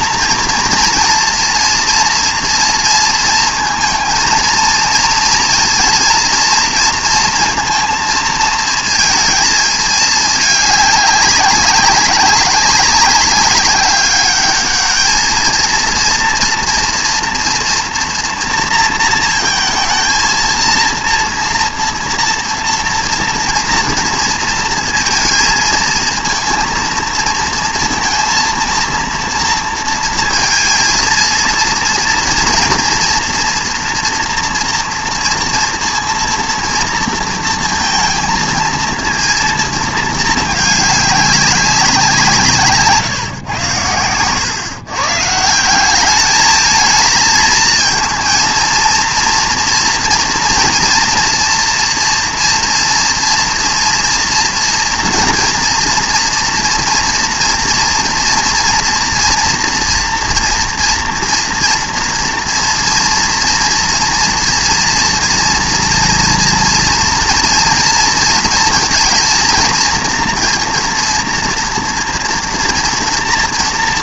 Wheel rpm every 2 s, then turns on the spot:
230, 230, 230, 230, 220, 200, 190, 210, 240, 230, 230, 240, 230, 230, 230, 230, 230, 230, 230, 230, 210, 150, 130, 220, 230, 230, 230, 230, 230, 230, 230, 230, 230, 230, 230, 240, 230.
none